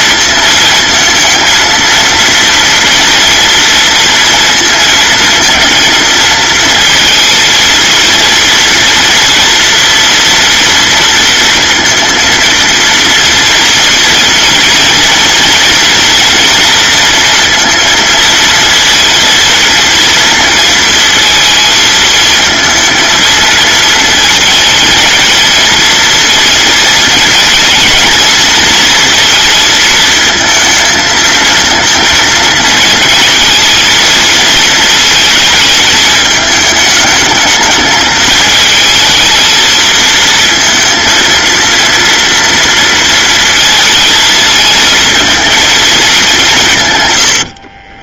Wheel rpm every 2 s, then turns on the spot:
220, 240, 220, 230, 230, 230, 230, 230, 230, 230, 230, 230, 230, 230, 230, 220, 230, 220, 220, 220, 230, 230, 230, 110.
46-48